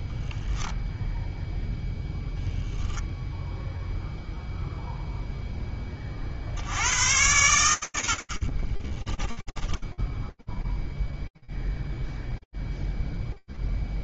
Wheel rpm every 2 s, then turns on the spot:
0, 0, 0, 50, 30, 0, 0.
8-10